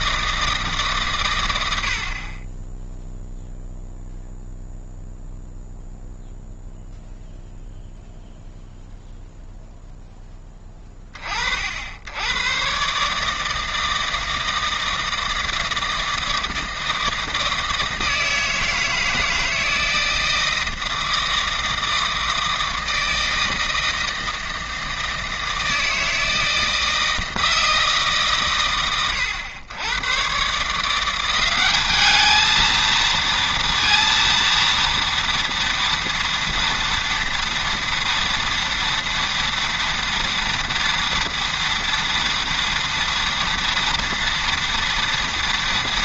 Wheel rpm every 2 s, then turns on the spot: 160, 20, 0, 0, 0, 10, 120, 160, 160, 160, 160, 160, 160, 160, 130, 140, 220, 230, 230, 230, 230, 230, 230.
none